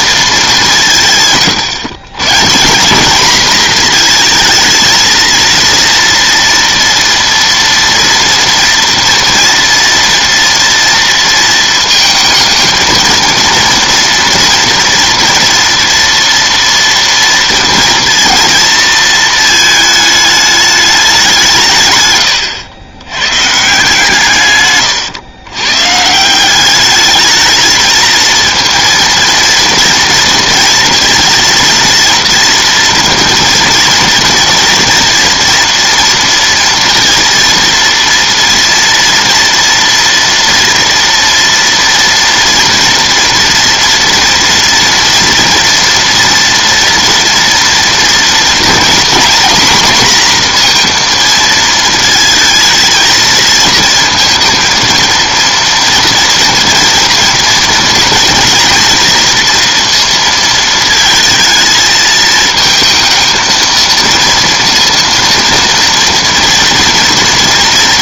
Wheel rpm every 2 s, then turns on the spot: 150, 210, 230, 240, 230, 230, 230, 230, 230, 220, 190, 110, 110, 210, 230, 230, 230, 230, 230, 230, 230, 230, 230, 230, 240, 230, 220, 230, 230, 230, 220, 220, 230, 230.
none